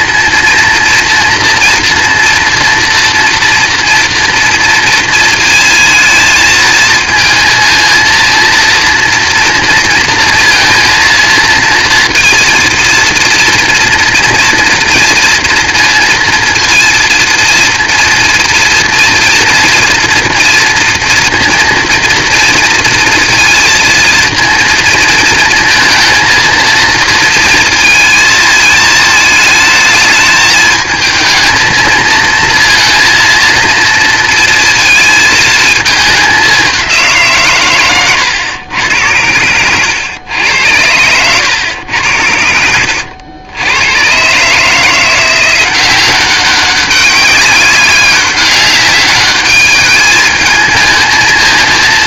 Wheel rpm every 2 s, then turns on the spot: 230, 240, 230, 220, 230, 230, 230, 240, 230, 240, 230, 230, 230, 230, 220, 220, 230, 230, 190, 100, 90, 80, 150, 190, 200, 220.
42-44